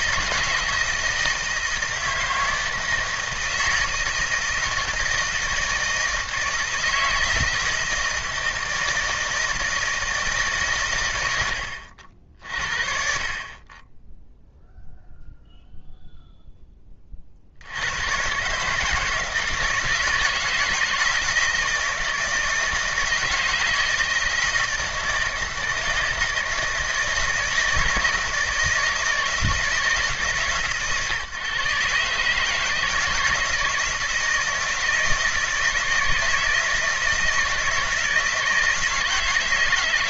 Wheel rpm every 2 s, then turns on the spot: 160, 160, 160, 160, 160, 130, 50, 0, 10, 150, 160, 160, 160, 160, 160, 140, 160, 160, 160, 160.
none